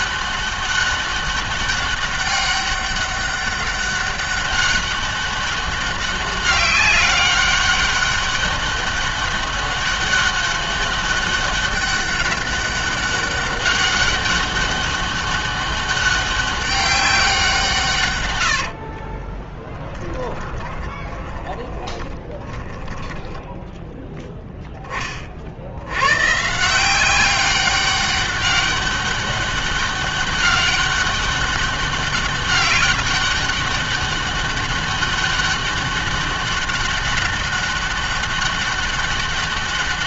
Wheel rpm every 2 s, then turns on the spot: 200, 200, 200, 200, 200, 200, 200, 200, 200, 60, 10, 20, 10, 160, 200, 200, 200, 200, 200, 200.
18-24